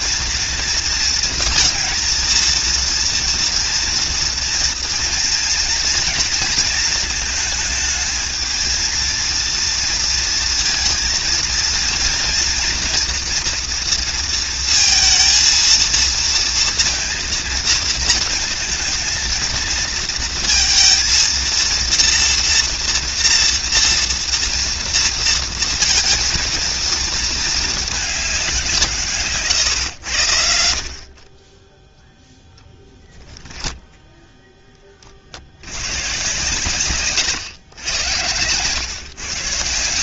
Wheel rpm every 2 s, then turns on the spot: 230, 230, 230, 230, 230, 230, 230, 230, 230, 220, 230, 240, 240, 230, 180, 70, 10, 20, 120, 110.
none